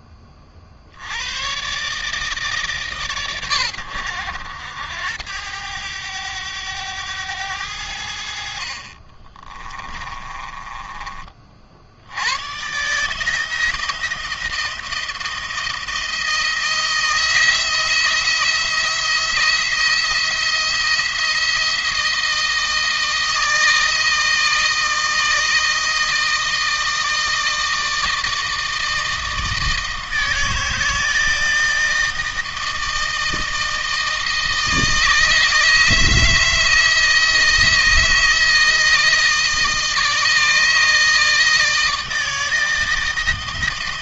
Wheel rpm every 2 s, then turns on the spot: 60, 140, 90, 100, 40, 30, 130, 160, 160, 170, 170, 160, 160, 160, 160, 160, 160, 160, 160, 160, 160, 160.
8-12